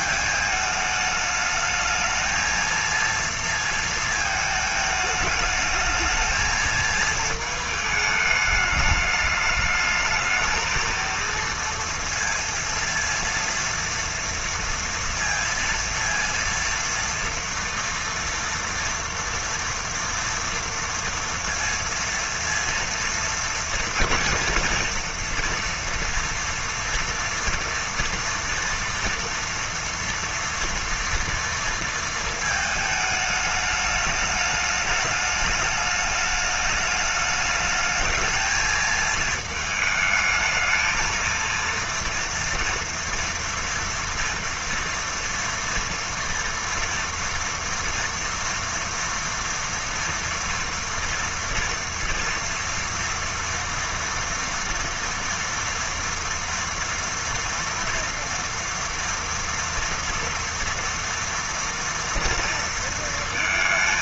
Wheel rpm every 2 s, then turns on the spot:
220, 220, 220, 220, 210, 220, 230, 230, 230, 230, 230, 230, 230, 240, 240, 230, 220, 210, 210, 220, 220, 230, 230, 240, 230, 230, 230, 230, 230, 230, 230, 230.
none